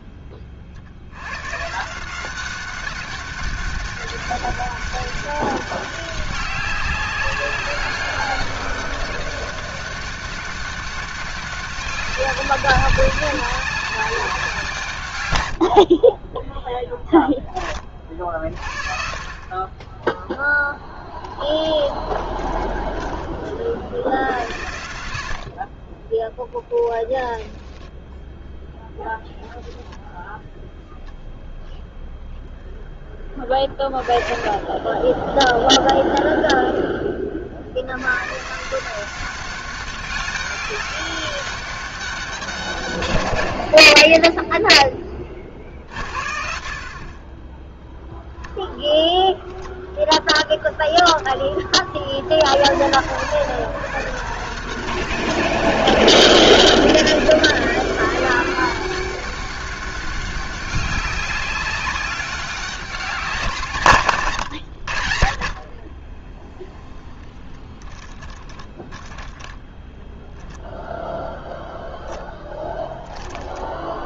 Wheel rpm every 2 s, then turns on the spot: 60, 190, 190, 190, 200, 190, 190, 140, 10, 40, 0, 10, 80, 10, 10, 0, 10, 20, 10, 170, 200, 140, 10, 50, 0, 10, 100, 170, 190, 190, 190, 200, 100, 0, 10, 0, 10.
26-30 68-70